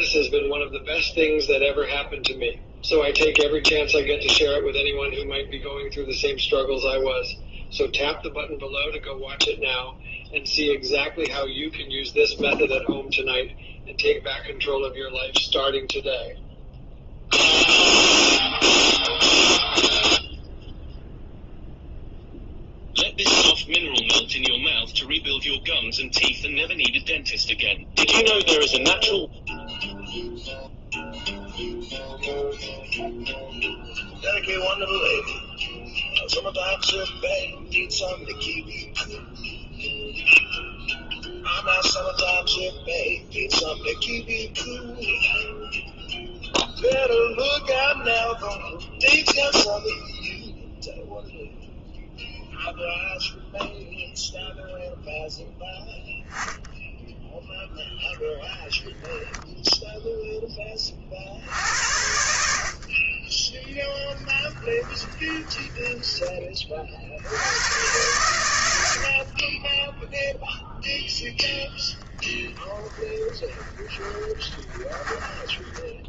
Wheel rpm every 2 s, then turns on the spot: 0, 0, 0, 0, 0, 0, 0, 0, 0, 0, 0, 0, 0, 0, 0, 0, 0, 0, 0, 0, 0, 0, 0, 0, 0, 0, 0, 0, 0, 0, 10, 60, 10, 30, 90, 0, 10, 10.
64-66 72-76